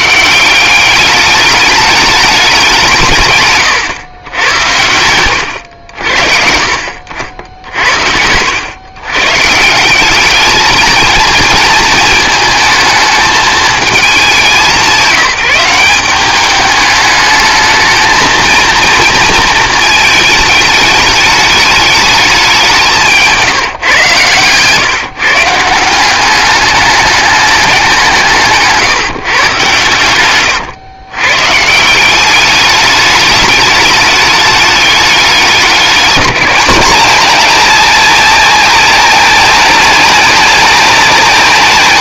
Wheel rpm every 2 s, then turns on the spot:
190, 180, 100, 60, 100, 220, 220, 190, 200, 230, 210, 190, 140, 200, 160, 110, 200, 210, 200, 230, 220.
28-30